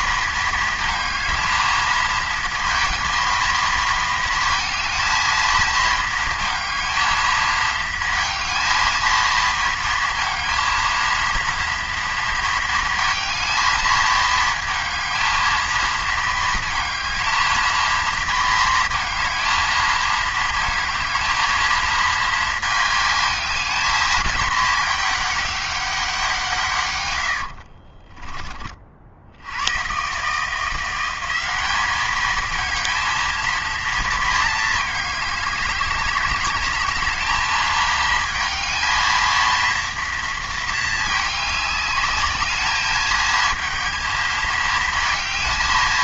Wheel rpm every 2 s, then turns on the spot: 230, 230, 230, 220, 230, 230, 220, 220, 220, 230, 220, 220, 220, 170, 20, 150, 220, 230, 200, 220, 230, 210, 220.
none